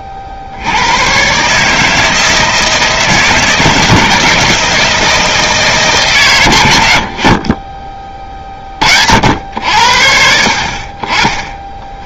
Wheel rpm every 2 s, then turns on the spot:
70, 160, 160, 130, 40, 40.
none